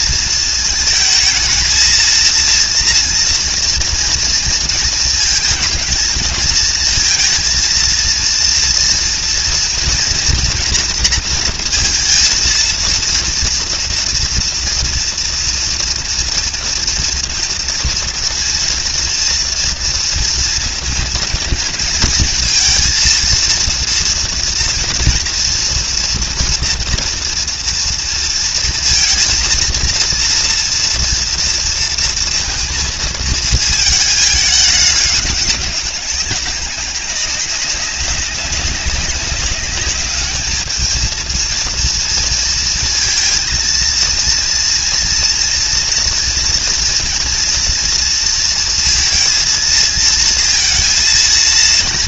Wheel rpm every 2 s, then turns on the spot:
220, 230, 220, 220, 230, 230, 230, 230, 230, 230, 230, 230, 230, 230, 230, 230, 230, 210, 190, 200, 220, 230, 230, 230, 230, 230.
none